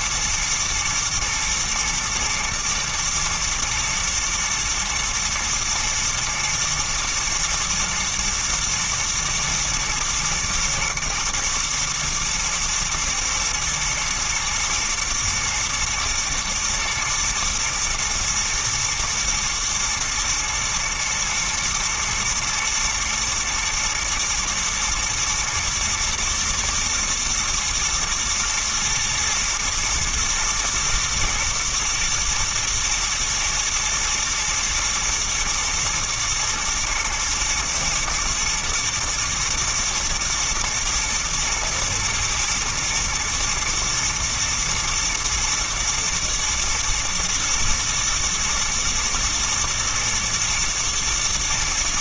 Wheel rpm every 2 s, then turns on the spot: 110, 120, 120, 110, 120, 120, 120, 120, 110, 120, 110, 120, 120, 120, 120, 110, 120, 120, 110, 110, 110, 110, 110, 110, 110, 110.
none